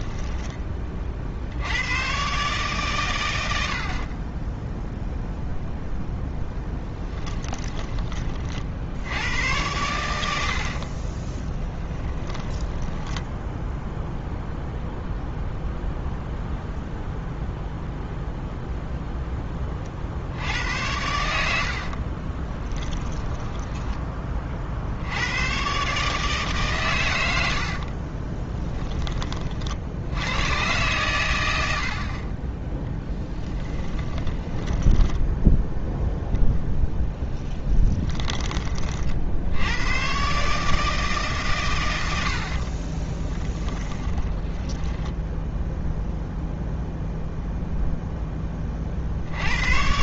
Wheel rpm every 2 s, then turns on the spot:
50, 90, 0, 10, 90, 30, 10, 0, 0, 0, 100, 20, 80, 110, 30, 110, 10, 10, 0, 60, 150, 20, 10, 0, 60.
6-8 10-14 22-24 34-36 42-44